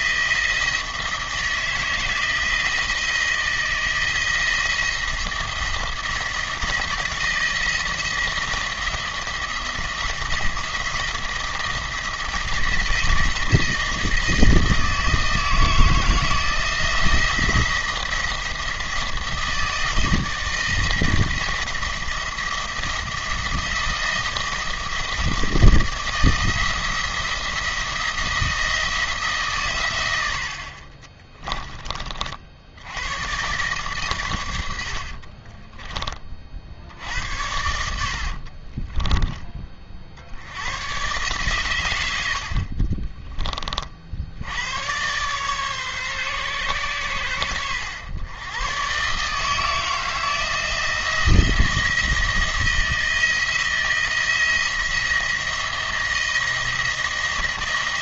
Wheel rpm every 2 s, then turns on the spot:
160, 160, 170, 170, 170, 170, 160, 160, 170, 160, 160, 170, 170, 170, 170, 50, 90, 80, 60, 30, 100, 50, 100, 120, 120, 170, 170, 170, 170.
30-32 34-36 38-40